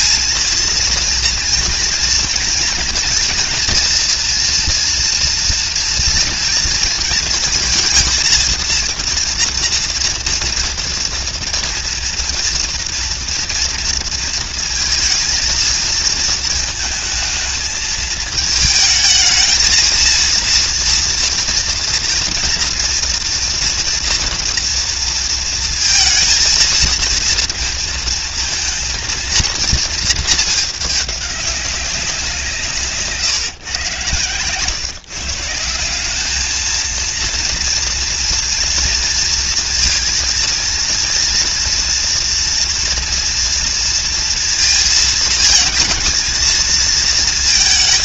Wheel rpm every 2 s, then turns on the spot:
230, 230, 230, 230, 220, 230, 230, 230, 230, 220, 230, 230, 240, 230, 230, 220, 180, 120, 200, 230, 230, 230, 230, 230.
none